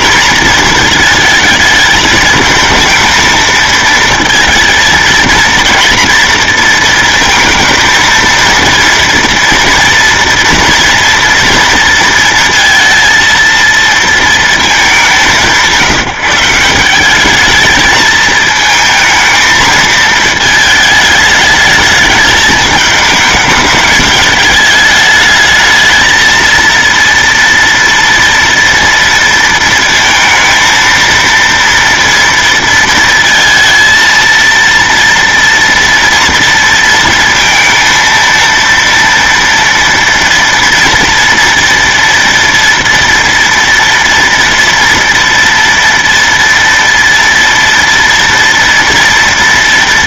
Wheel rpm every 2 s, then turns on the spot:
220, 220, 230, 230, 230, 230, 230, 220, 180, 220, 220, 210, 210, 230, 230, 230, 230, 230, 230, 230, 230, 230, 230, 230, 230.
none